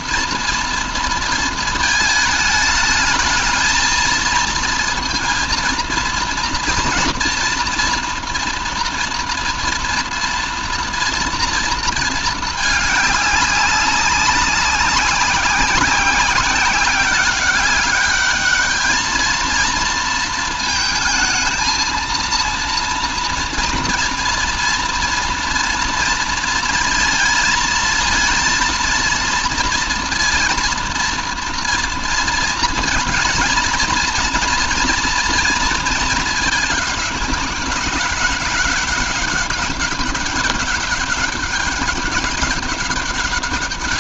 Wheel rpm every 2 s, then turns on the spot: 230, 220, 230, 230, 230, 240, 210, 190, 190, 210, 220, 230, 230, 230, 230, 230, 230, 230, 210, 200, 200, 200.
none